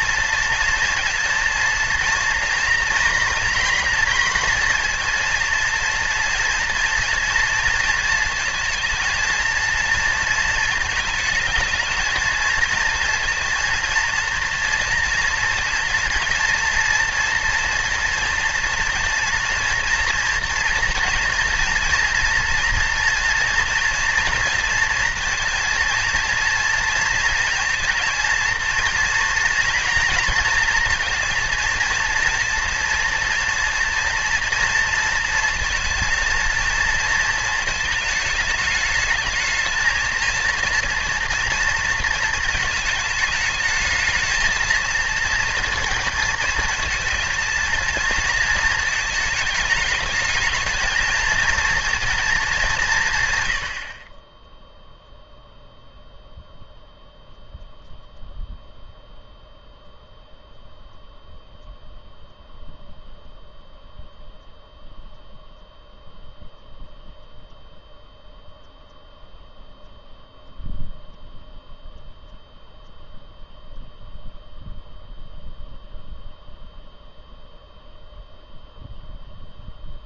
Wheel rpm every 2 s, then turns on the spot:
230, 240, 230, 240, 230, 220, 230, 230, 230, 230, 230, 230, 230, 230, 230, 230, 230, 230, 230, 210, 230, 220, 220, 220, 220, 220, 180, 0, 0, 0, 0, 0, 0, 0, 0, 0, 0, 0, 0, 0.
none